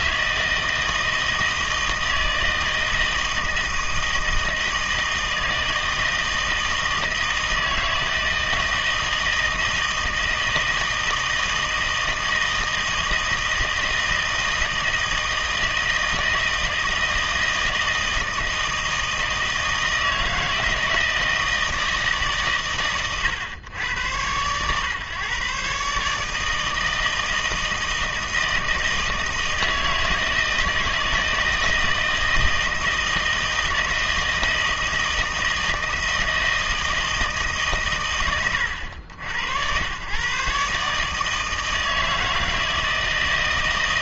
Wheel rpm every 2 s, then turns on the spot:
160, 160, 160, 160, 160, 160, 160, 160, 160, 160, 160, 150, 120, 150, 160, 160, 160, 160, 160, 100, 130, 160.
none